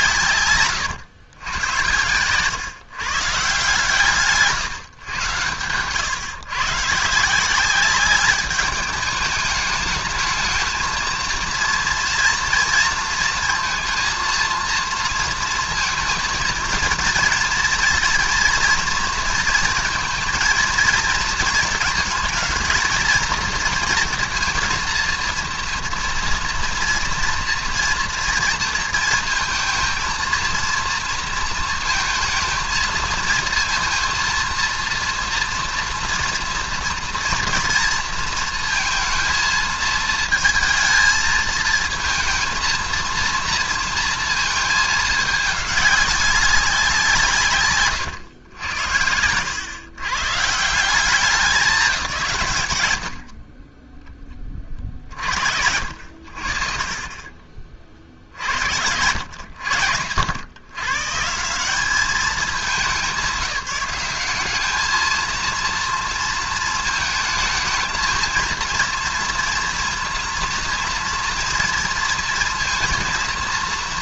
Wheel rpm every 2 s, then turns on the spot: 160, 110, 160, 130, 200, 210, 230, 230, 230, 230, 230, 220, 240, 230, 230, 230, 230, 230, 240, 230, 220, 230, 230, 200, 120, 110, 190, 10, 70, 50, 90, 210, 190, 230, 220, 230, 230.
none